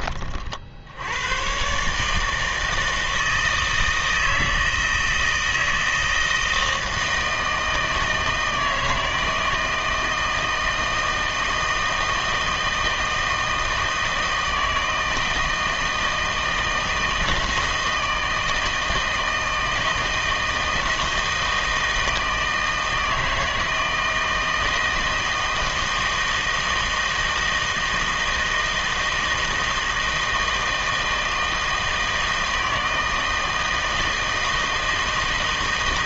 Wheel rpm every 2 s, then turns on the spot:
60, 160, 160, 160, 160, 160, 160, 160, 160, 160, 160, 160, 160, 160, 160, 160, 160, 160.
none